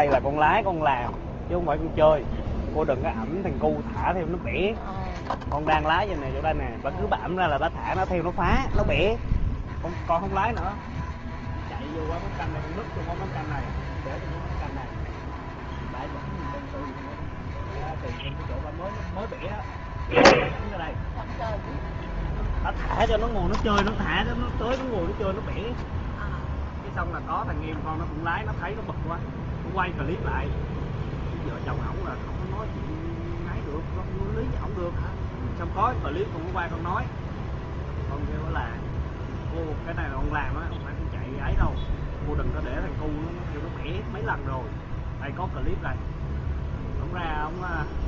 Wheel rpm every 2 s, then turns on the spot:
0, 0, 0, 0, 0, 0, 0, 0, 0, 0, 0, 0, 0, 0, 0, 0, 0, 0, 0, 0, 0, 0, 0, 0.
none